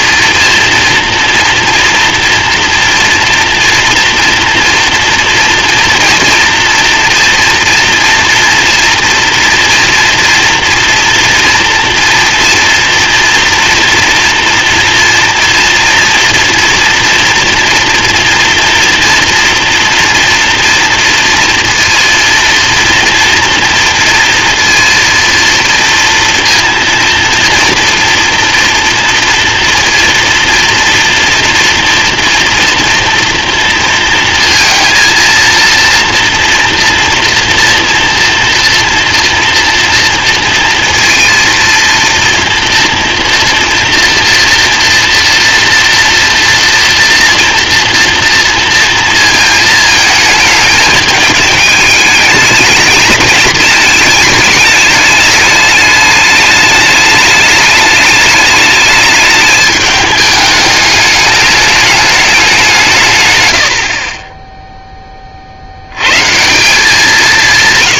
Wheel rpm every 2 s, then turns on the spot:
230, 230, 230, 230, 230, 230, 230, 230, 240, 230, 240, 230, 230, 230, 230, 230, 230, 230, 240, 230, 230, 240, 230, 230, 230, 220, 210, 210, 210, 210, 210, 190, 10, 170.
none